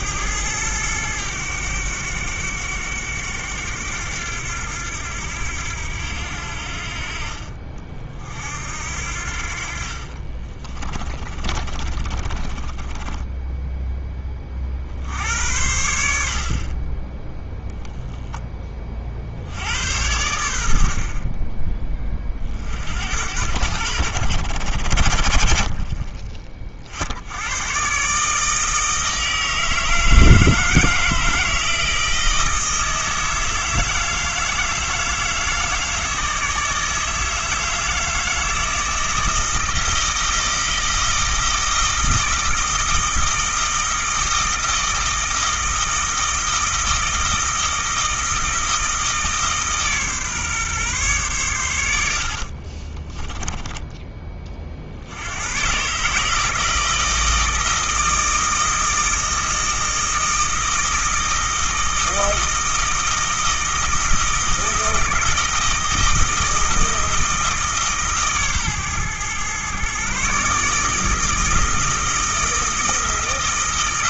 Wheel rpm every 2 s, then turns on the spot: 110, 100, 90, 60, 70, 30, 10, 70, 30, 30, 60, 60, 80, 60, 160, 160, 160, 160, 160, 160, 160, 160, 160, 160, 160, 130, 30, 60, 160, 160, 160, 160, 160, 160, 120, 160, 160.
10-14 52-54